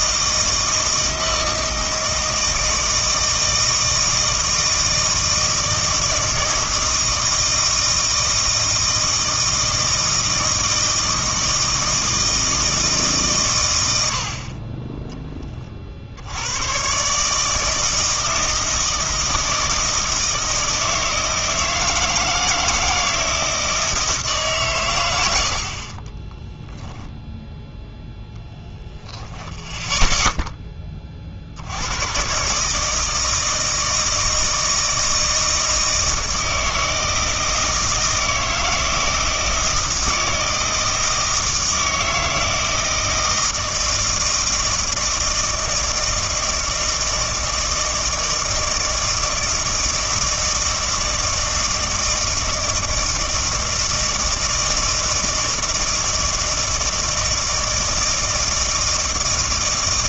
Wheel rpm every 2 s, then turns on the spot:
160, 160, 160, 160, 160, 160, 160, 30, 100, 160, 160, 160, 140, 10, 0, 10, 140, 160, 160, 160, 160, 160, 160, 160, 160, 160, 160, 160, 160, 160.
26-28